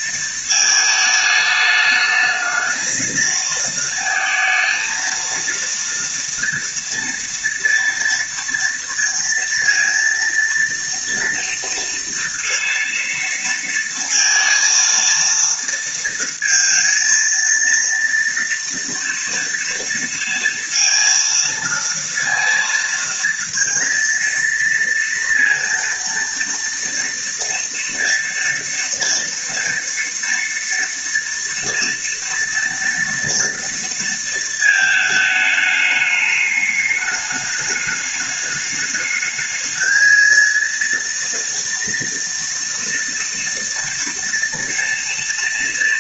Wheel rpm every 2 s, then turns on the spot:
220, 220, 230, 230, 230, 230, 230, 230, 230, 230, 230, 230, 230, 230, 240, 230, 230, 220, 210, 210, 230, 230, 230.
none